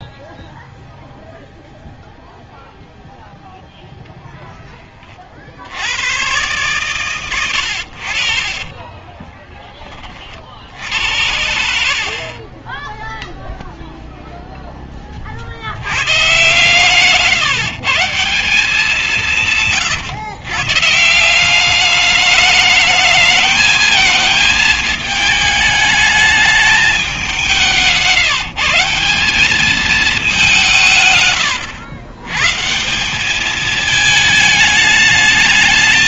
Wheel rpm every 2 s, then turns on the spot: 0, 0, 10, 130, 40, 60, 20, 10, 130, 180, 150, 220, 220, 210, 170, 180, 150, 220.
8-10 12-14 16-18 30-32